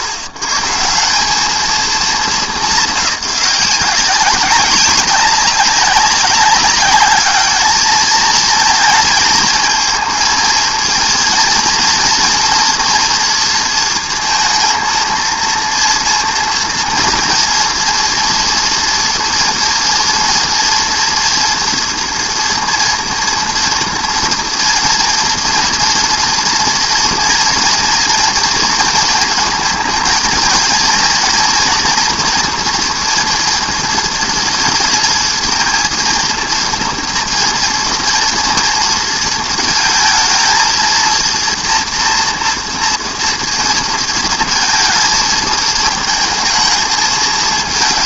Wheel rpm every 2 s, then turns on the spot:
80, 200, 190, 190, 220, 230, 230, 230, 230, 230, 230, 230, 230, 230, 230, 230, 240, 230, 230, 230, 230, 230, 230, 220.
none